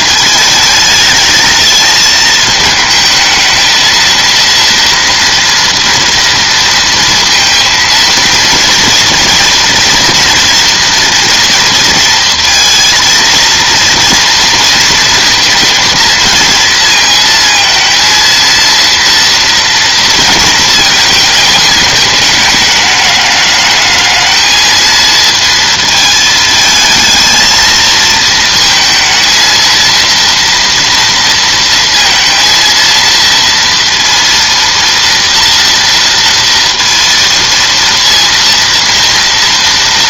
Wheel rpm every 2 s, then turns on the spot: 220, 220, 240, 230, 230, 230, 230, 230, 230, 230, 220, 210, 220, 220, 220, 230, 230, 230, 230, 230.
none